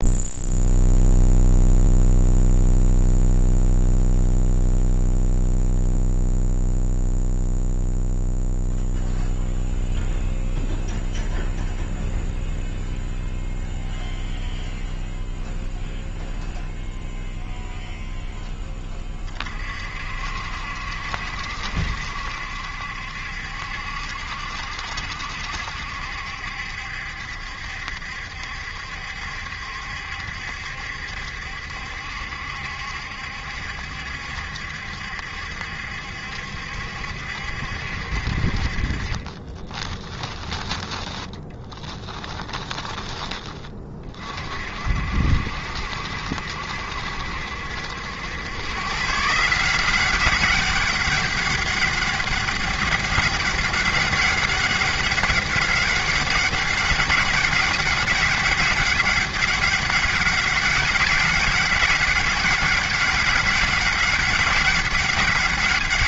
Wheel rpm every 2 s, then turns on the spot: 0, 0, 0, 0, 0, 0, 0, 0, 0, 20, 70, 70, 70, 70, 70, 70, 70, 70, 70, 40, 10, 10, 50, 70, 130, 200, 200, 200, 200, 190, 200, 200, 200.
38-40